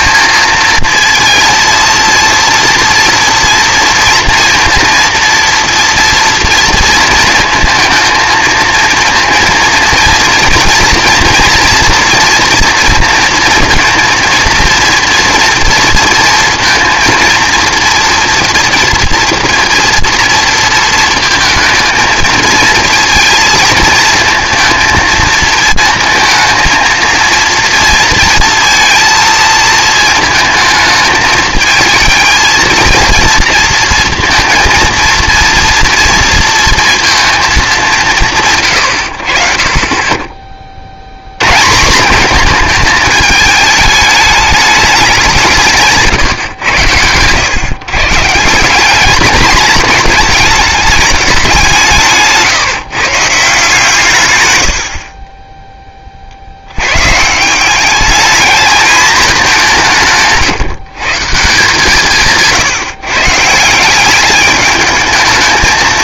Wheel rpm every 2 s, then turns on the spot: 230, 230, 230, 230, 220, 230, 230, 230, 230, 230, 230, 230, 230, 220, 230, 220, 230, 230, 230, 120, 40, 220, 210, 120, 180, 220, 150, 90, 80, 210, 150, 150, 210.
none